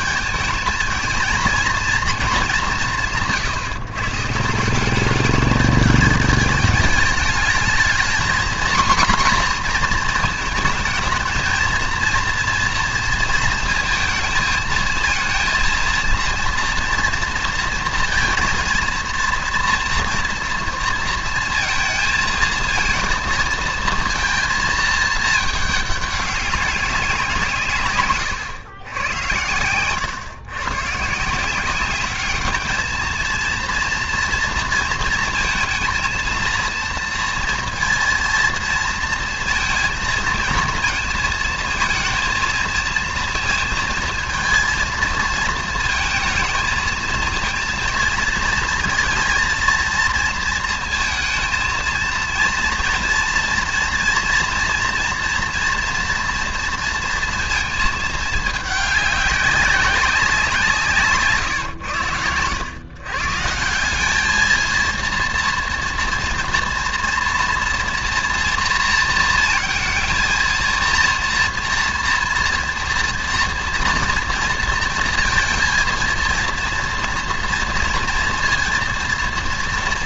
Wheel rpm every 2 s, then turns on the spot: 220, 200, 170, 210, 240, 220, 230, 230, 230, 230, 230, 230, 230, 200, 100, 120, 210, 230, 230, 230, 230, 230, 230, 230, 230, 220, 230, 230, 230, 210, 170, 110, 220, 230, 230, 230, 230, 230, 230, 230.
none